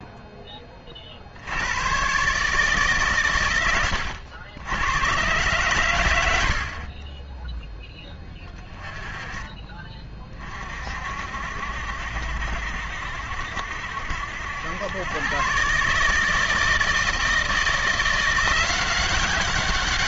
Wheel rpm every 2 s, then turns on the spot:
10, 150, 90, 70, 20, 40, 70, 90, 160, 180.
none